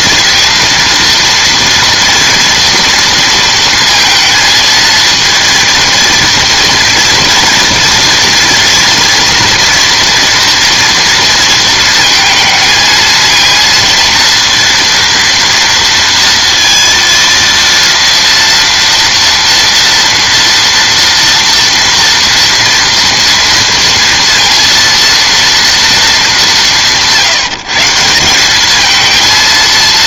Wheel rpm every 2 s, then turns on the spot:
230, 230, 230, 230, 230, 230, 220, 230, 230, 230, 230, 230, 230, 180, 210.
none